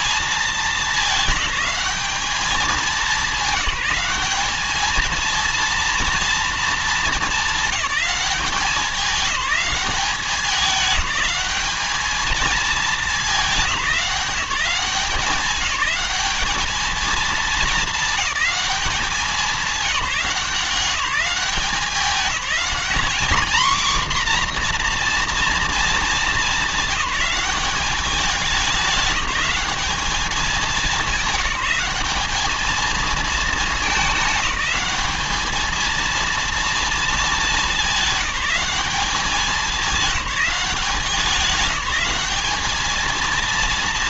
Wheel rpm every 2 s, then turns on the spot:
210, 190, 220, 210, 200, 200, 210, 200, 220, 200, 190, 230, 240, 200, 200, 190, 220, 210, 220, 200, 190, 210.
none